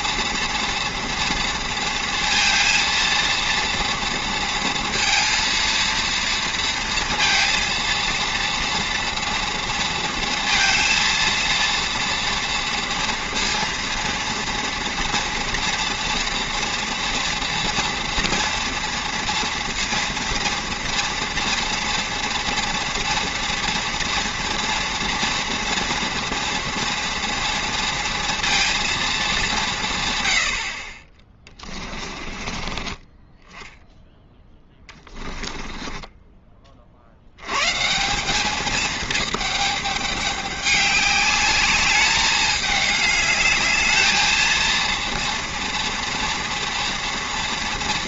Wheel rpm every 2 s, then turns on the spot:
230, 230, 230, 230, 230, 230, 230, 230, 230, 230, 240, 230, 230, 240, 230, 70, 20, 10, 20, 210, 200, 210, 230, 230.
30-36